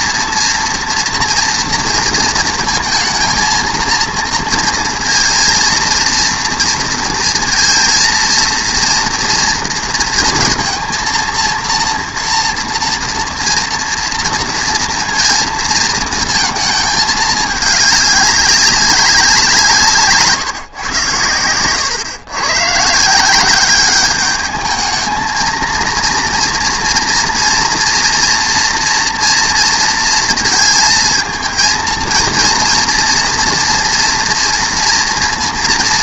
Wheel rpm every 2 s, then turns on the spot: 230, 230, 230, 230, 230, 230, 230, 230, 220, 200, 140, 130, 210, 230, 230, 230, 230, 240.
none